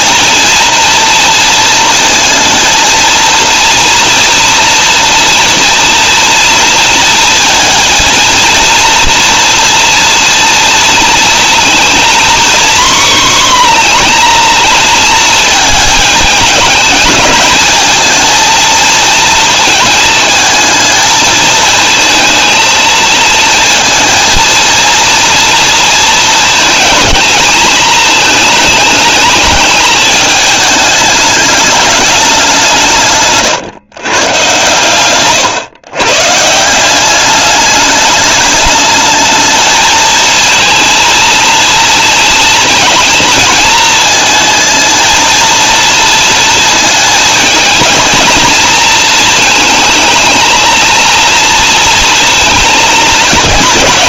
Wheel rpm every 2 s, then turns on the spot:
230, 230, 230, 230, 230, 220, 250, 230, 220, 230, 220, 220, 230, 220, 210, 210, 150, 140, 190, 210, 230, 230, 220, 220, 220, 230, 220.
34-36